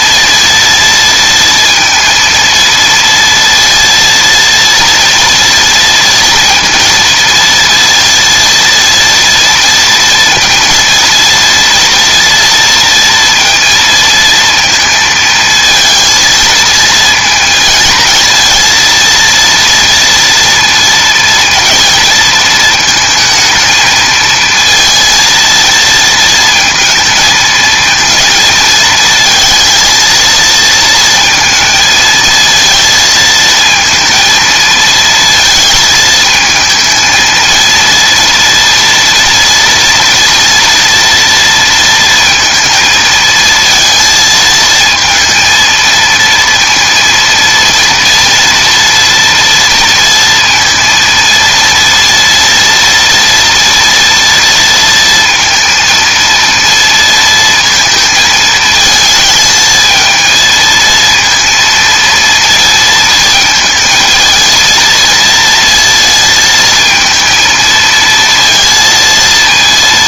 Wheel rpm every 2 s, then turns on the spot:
230, 230, 230, 230, 230, 230, 230, 230, 220, 230, 230, 220, 230, 230, 230, 230, 230, 230, 220, 230, 230, 220, 230, 230, 230, 230, 230, 230, 230, 220, 230, 230, 230, 230, 230.
none